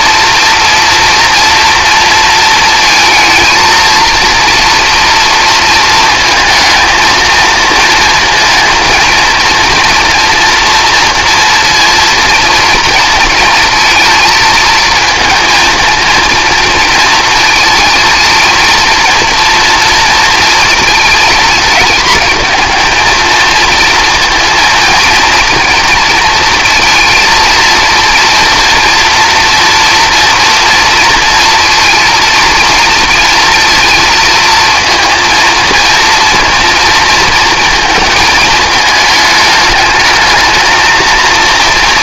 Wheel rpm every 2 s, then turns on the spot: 230, 230, 230, 230, 230, 230, 230, 220, 220, 230, 230, 230, 230, 230, 230, 230, 230, 230, 230, 220, 220.
none